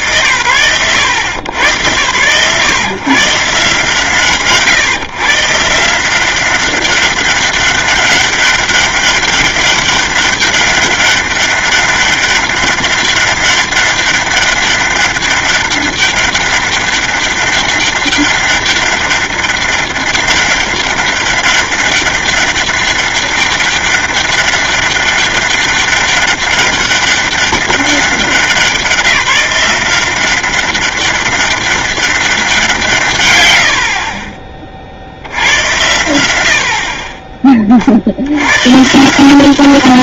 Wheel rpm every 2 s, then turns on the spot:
110, 130, 150, 200, 200, 200, 200, 200, 200, 200, 200, 200, 200, 200, 170, 200, 90, 90, 20, 180.
none